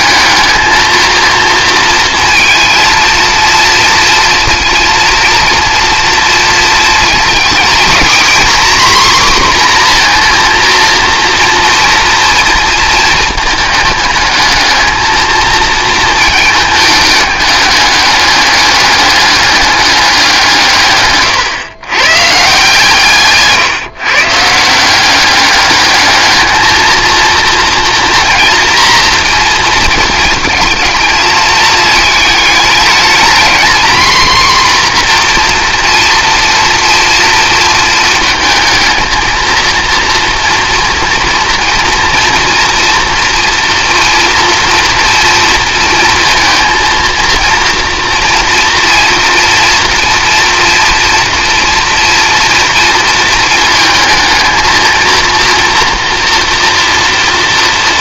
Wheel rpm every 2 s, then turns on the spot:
220, 230, 230, 230, 250, 240, 230, 220, 220, 200, 150, 150, 160, 220, 240, 230, 210, 250, 230, 230, 230, 240, 240, 230, 230, 230, 230, 230, 230.
none